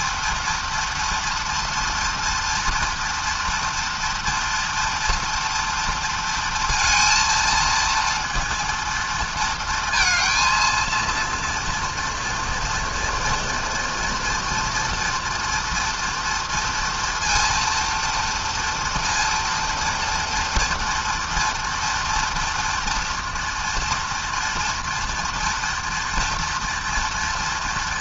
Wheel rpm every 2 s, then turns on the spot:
230, 230, 230, 230, 230, 230, 230, 230, 230, 230, 230, 230, 230, 240.
none